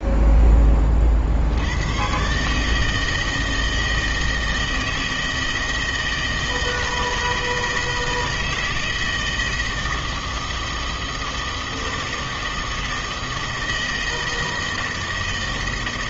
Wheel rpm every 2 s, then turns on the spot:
20, 150, 160, 160, 160, 160, 160, 160.
none